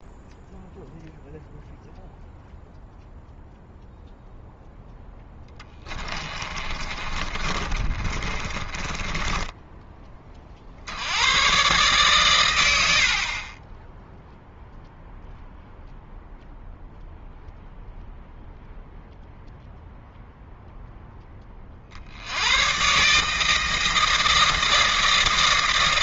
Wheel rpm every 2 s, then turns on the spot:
0, 0, 0, 30, 20, 60, 70, 0, 0, 0, 0, 130, 160.
6-10